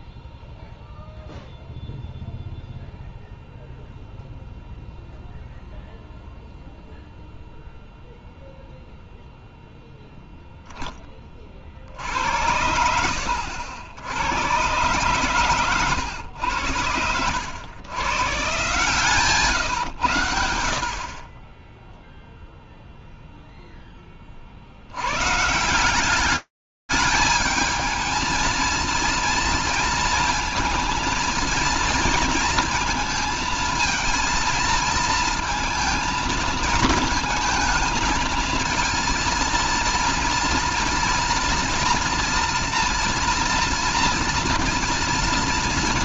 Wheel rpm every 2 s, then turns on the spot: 0, 0, 0, 0, 0, 10, 80, 110, 100, 140, 90, 0, 60, 210, 230, 230, 230, 230, 220, 230, 240, 240, 230.
none